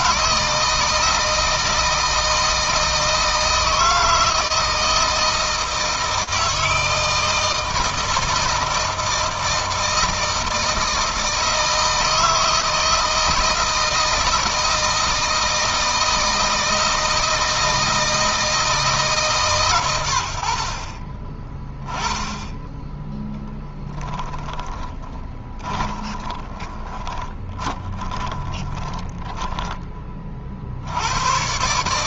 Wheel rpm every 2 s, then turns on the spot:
160, 160, 160, 160, 160, 160, 160, 160, 160, 150, 40, 10, 20, 30, 20, 60.
24-30